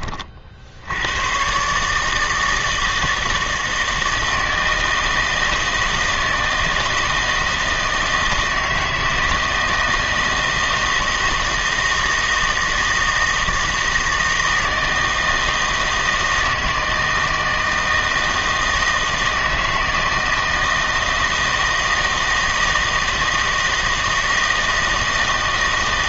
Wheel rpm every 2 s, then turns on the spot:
60, 160, 160, 160, 160, 160, 160, 160, 160, 160, 160, 160, 160.
none